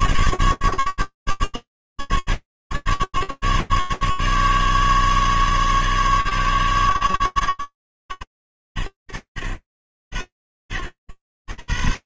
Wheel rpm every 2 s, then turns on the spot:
150, 150, 140, 140, 120, 80.
none